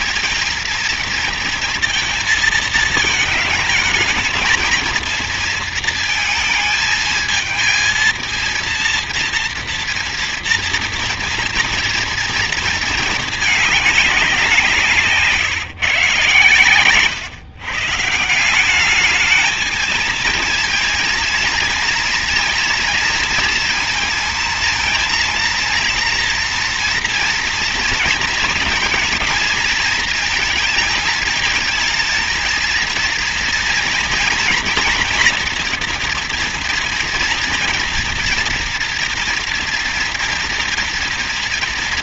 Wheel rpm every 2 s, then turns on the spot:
230, 220, 230, 220, 230, 230, 220, 160, 140, 210, 230, 230, 230, 230, 220, 230, 230, 240, 230, 230, 230.
none